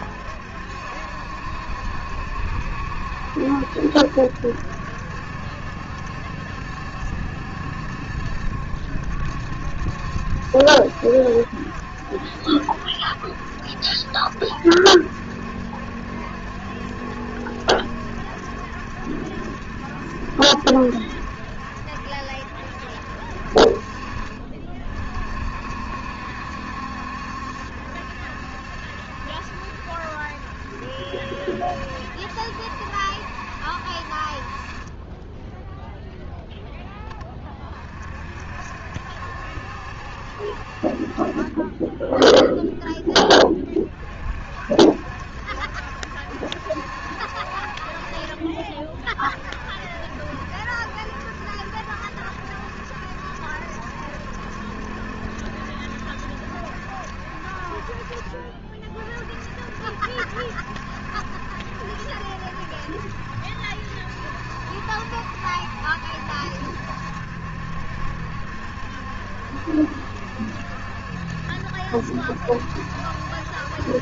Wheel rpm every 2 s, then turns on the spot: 70, 70, 70, 70, 70, 70, 70, 70, 70, 70, 70, 70, 30, 70, 70, 70, 70, 40, 0, 60, 60, 0, 50, 70, 40, 70, 70, 70, 70, 50, 70, 70, 70, 70, 70, 70, 70.
none